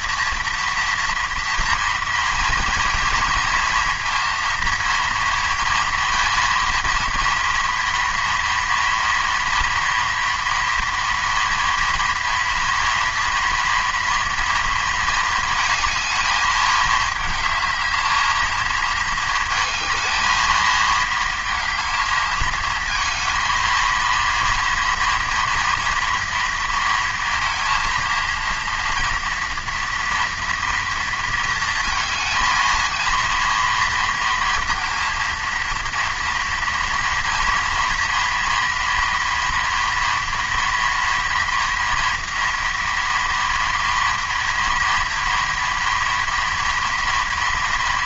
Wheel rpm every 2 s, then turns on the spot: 230, 230, 230, 230, 230, 230, 230, 230, 220, 220, 220, 220, 230, 230, 230, 230, 220, 230, 230, 230, 230, 240, 230, 230.
none